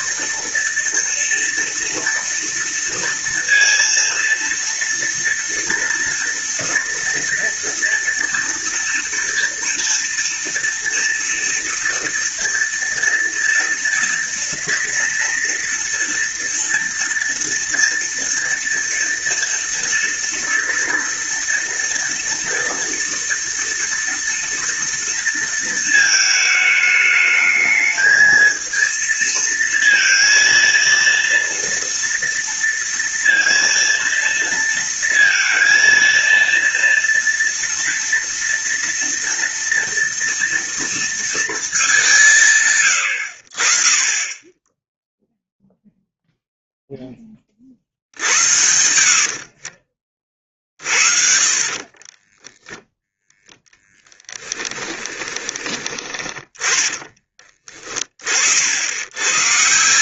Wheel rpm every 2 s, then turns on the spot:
230, 230, 230, 230, 230, 230, 230, 230, 230, 230, 230, 230, 230, 220, 220, 230, 230, 230, 230, 230, 230, 130, 10, 0, 80, 40, 0, 10, 20, 70.
48-50 54-56